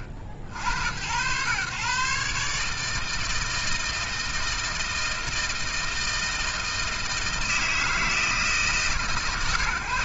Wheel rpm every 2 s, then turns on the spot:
80, 150, 160, 160, 140.
none